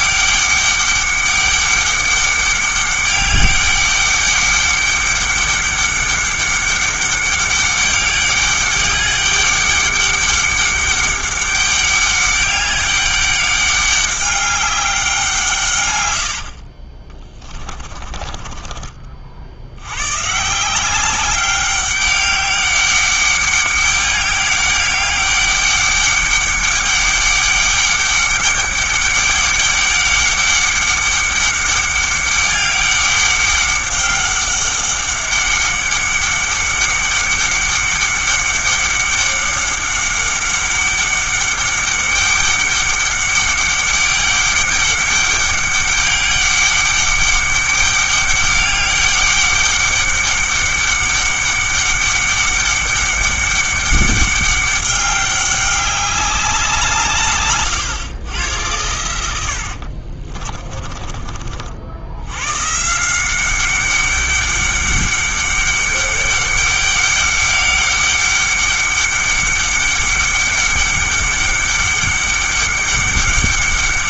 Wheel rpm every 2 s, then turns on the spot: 200, 200, 200, 200, 200, 200, 200, 200, 40, 30, 170, 200, 200, 200, 200, 200, 200, 200, 200, 200, 200, 200, 200, 200, 200, 200, 200, 200, 180, 110, 30, 140, 200, 200, 200, 200, 200.
16-20 60-62